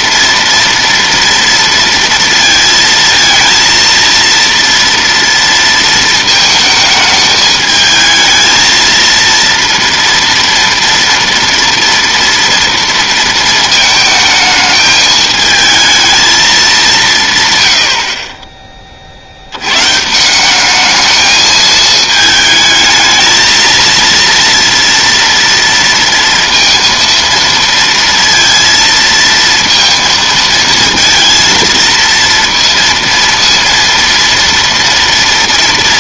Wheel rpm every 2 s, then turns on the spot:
230, 230, 230, 220, 230, 230, 230, 220, 190, 30, 200, 220, 230, 230, 230, 230, 230, 230.
none